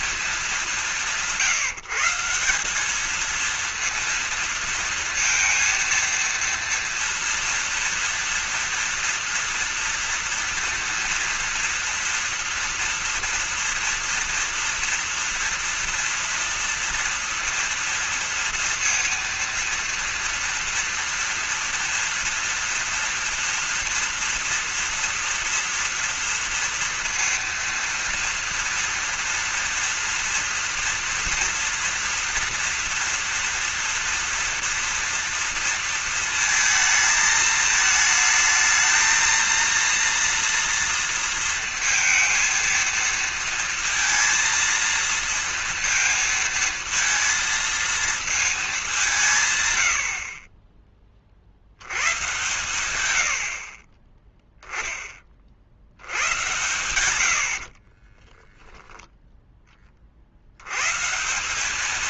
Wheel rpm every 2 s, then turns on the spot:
200, 180, 230, 230, 230, 230, 230, 230, 230, 230, 230, 240, 230, 230, 230, 230, 230, 240, 220, 220, 230, 230, 230, 230, 220, 40, 130, 10, 90, 10, 80.
50-52 58-60